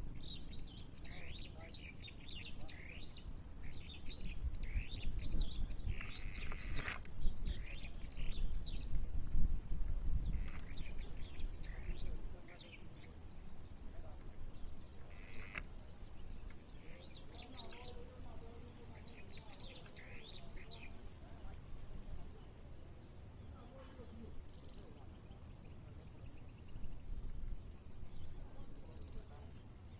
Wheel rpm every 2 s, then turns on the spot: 0, 0, 0, 0, 0, 0, 0, 0, 0, 0, 0, 0, 0, 0, 0.
none